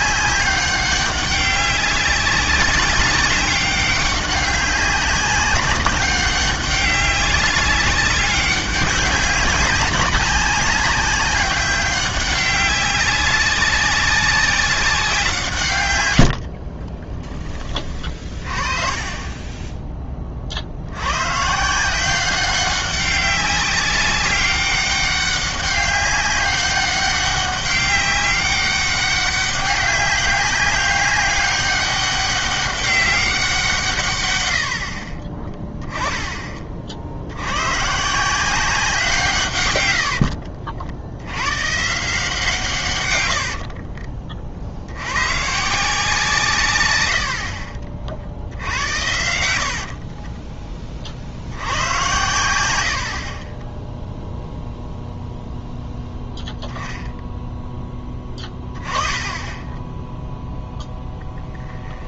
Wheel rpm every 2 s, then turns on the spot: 200, 200, 200, 200, 200, 200, 190, 190, 40, 30, 70, 190, 200, 200, 200, 190, 200, 80, 30, 180, 80, 140, 70, 120, 70, 30, 80, 0, 0, 20, 0.
16-20 48-50